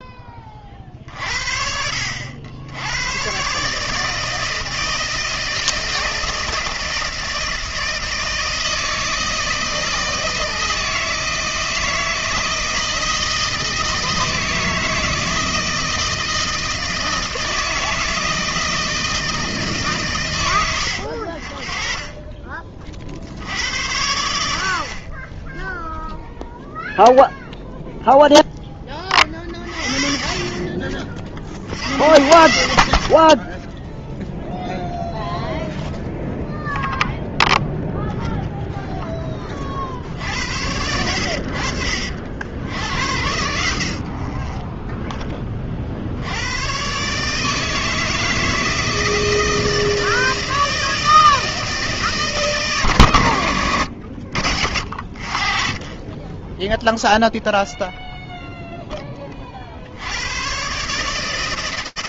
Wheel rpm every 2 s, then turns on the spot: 40, 90, 160, 160, 160, 160, 160, 160, 160, 160, 90, 30, 50, 0, 20, 40, 60, 0, 0, 0, 80, 80, 10, 120, 160, 160, 130, 60, 0, 10, 140.
none